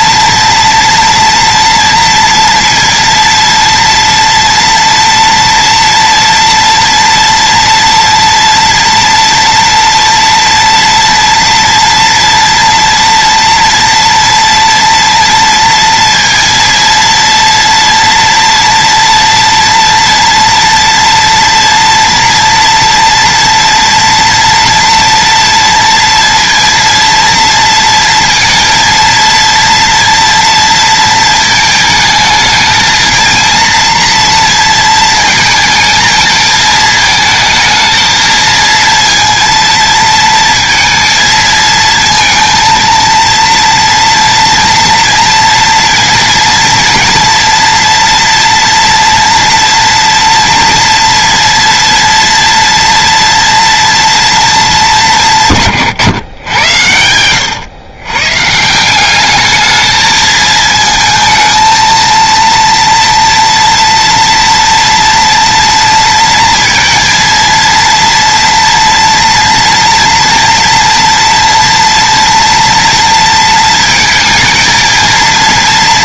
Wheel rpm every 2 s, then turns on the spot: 230, 230, 230, 230, 230, 230, 230, 230, 230, 230, 230, 230, 230, 230, 230, 230, 230, 230, 220, 230, 230, 230, 230, 230, 230, 230, 230, 220, 100, 160, 220, 230, 230, 230, 230, 230, 230, 220.
none